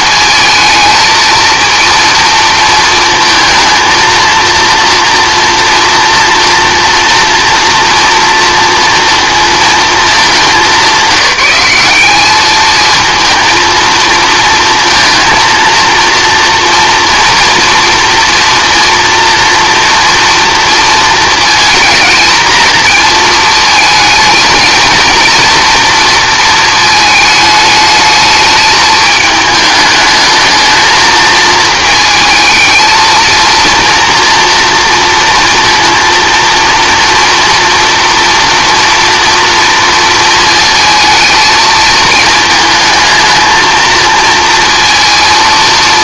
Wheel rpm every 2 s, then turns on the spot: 230, 230, 230, 240, 230, 200, 220, 230, 230, 230, 230, 220, 220, 230, 210, 220, 220, 230, 230, 230, 230, 220, 230.
none